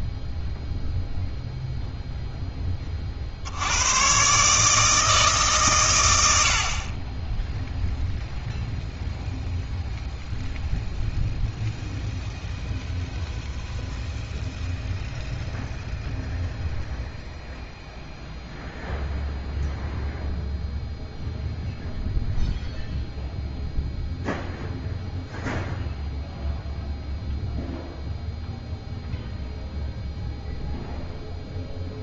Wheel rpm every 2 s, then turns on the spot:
0, 20, 150, 50, 0, 0, 0, 0, 0, 0, 0, 0, 0, 0, 0, 0.
none